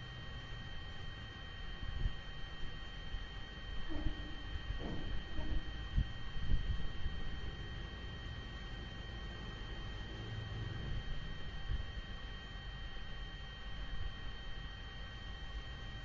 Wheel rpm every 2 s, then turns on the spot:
0, 0, 0, 0, 0, 0, 0, 0.
none